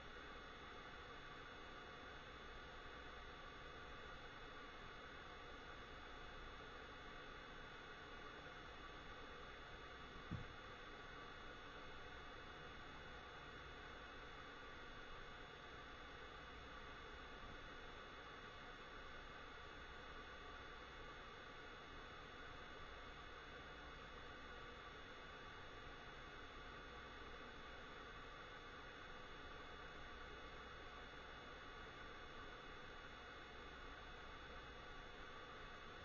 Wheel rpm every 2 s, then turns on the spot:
0, 0, 0, 0, 0, 0, 0, 0, 0, 0, 0, 0, 0, 0, 0, 0, 0, 0.
none